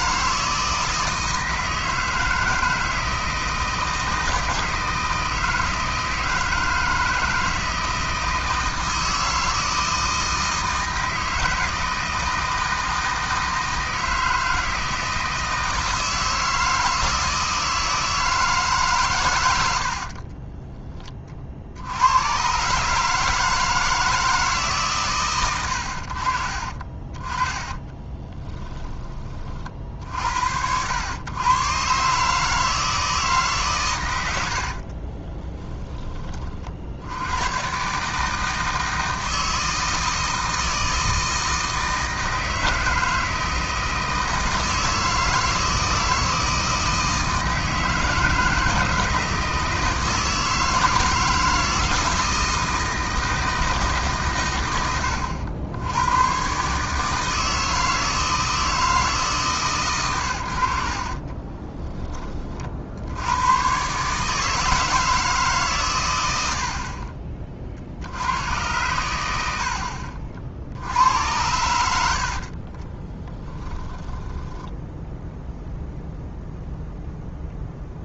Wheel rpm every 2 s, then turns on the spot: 160, 160, 160, 160, 160, 160, 160, 160, 160, 150, 20, 140, 150, 40, 10, 80, 160, 70, 40, 160, 160, 160, 160, 160, 160, 160, 160, 110, 130, 160, 80, 40, 160, 70, 110, 60, 40, 0, 0.
34-36 72-74